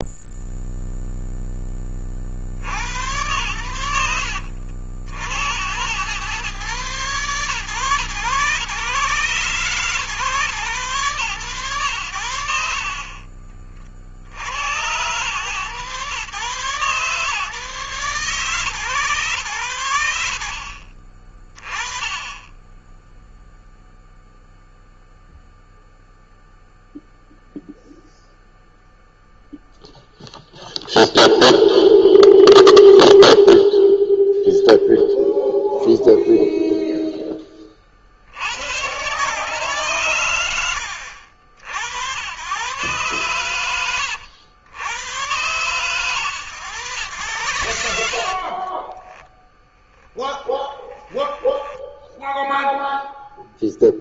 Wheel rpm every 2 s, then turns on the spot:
0, 80, 70, 130, 120, 120, 50, 100, 140, 130, 40, 10, 0, 0, 0, 0, 0, 0, 0, 110, 80, 130, 110, 100, 30, 20, 0.
48-52